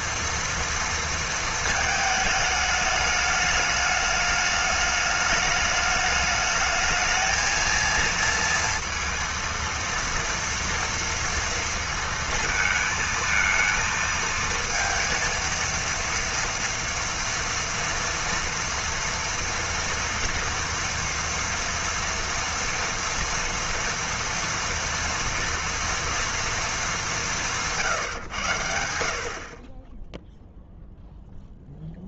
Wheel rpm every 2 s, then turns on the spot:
230, 210, 210, 220, 230, 230, 230, 230, 230, 230, 230, 240, 230, 220, 120, 0.
none